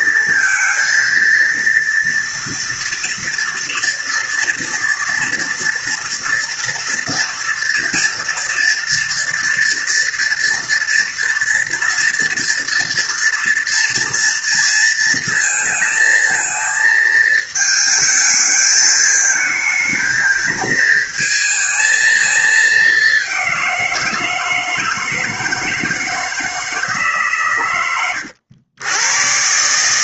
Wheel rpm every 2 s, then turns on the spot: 230, 230, 230, 230, 230, 230, 230, 230, 220, 220, 220, 210, 160, 160, 90.
none